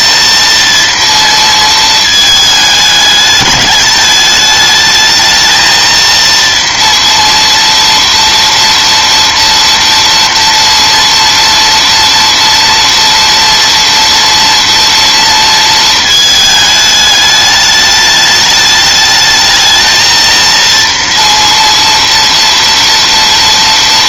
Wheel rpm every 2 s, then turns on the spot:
230, 220, 210, 230, 230, 230, 230, 230, 220, 210, 230, 230.
none